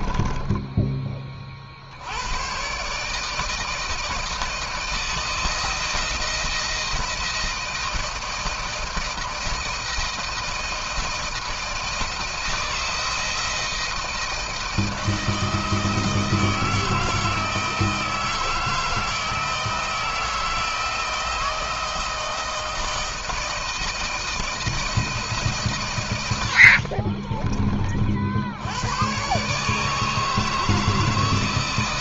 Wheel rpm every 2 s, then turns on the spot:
20, 120, 160, 160, 160, 160, 160, 160, 160, 160, 160, 160, 160, 70, 90, 160.
0-2 26-28